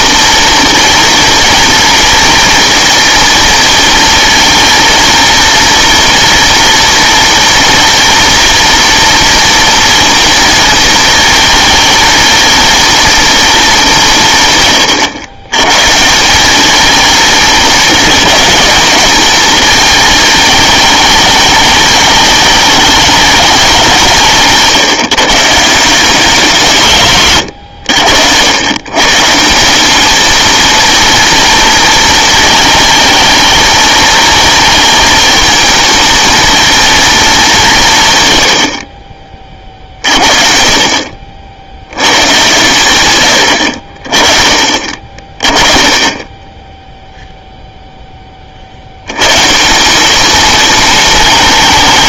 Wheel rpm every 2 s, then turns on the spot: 240, 230, 230, 240, 240, 230, 230, 130, 200, 210, 210, 210, 160, 170, 100, 230, 220, 220, 220, 90, 50, 110, 40, 10, 40, 220.
none